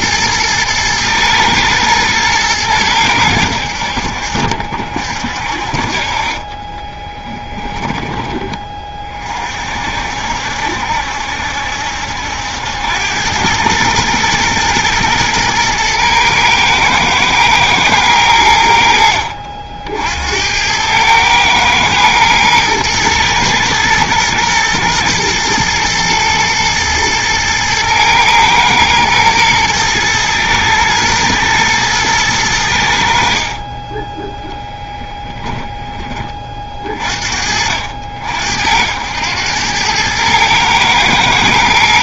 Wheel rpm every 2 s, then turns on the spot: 110, 100, 50, 30, 20, 70, 90, 120, 110, 80, 90, 110, 110, 110, 110, 110, 90, 0, 30, 70, 110.
6-8